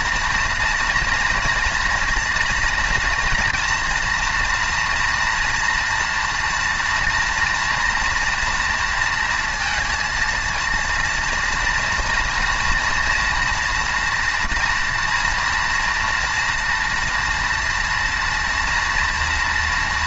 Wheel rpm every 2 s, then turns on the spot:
240, 230, 230, 230, 230, 230, 230, 230, 240, 230.
none